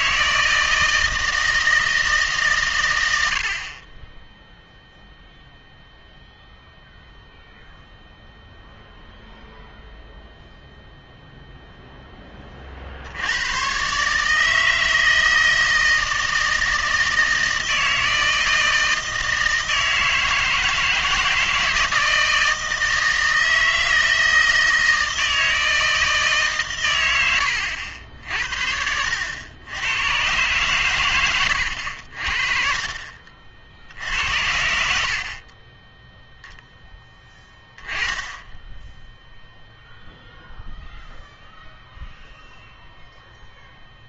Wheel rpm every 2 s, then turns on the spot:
160, 140, 0, 0, 0, 0, 40, 160, 160, 160, 160, 160, 160, 140, 60, 120, 40, 80, 0, 10, 0, 0.
none